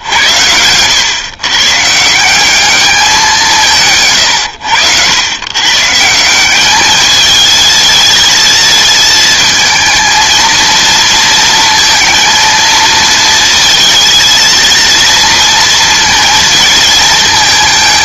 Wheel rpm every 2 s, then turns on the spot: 110, 210, 100, 210, 220, 230, 230, 230, 220.
none